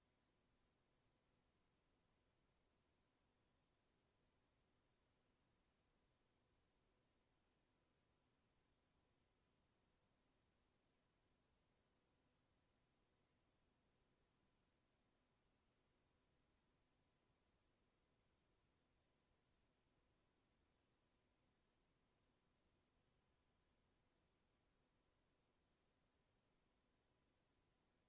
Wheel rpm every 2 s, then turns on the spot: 0, 0, 0, 0, 0, 0, 0, 0, 0, 0, 0, 0, 0, 0.
none